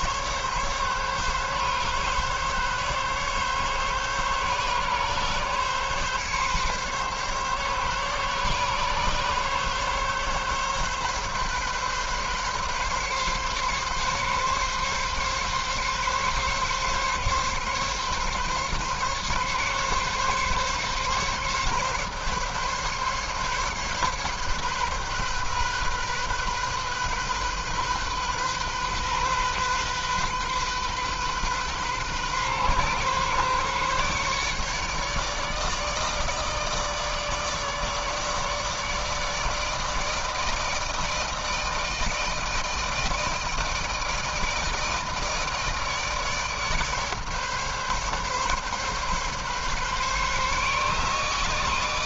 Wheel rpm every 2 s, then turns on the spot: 140, 140, 140, 140, 140, 140, 140, 140, 140, 140, 140, 140, 130, 130, 130, 130, 130, 150, 150, 150, 160, 160, 160, 140, 140, 150.
none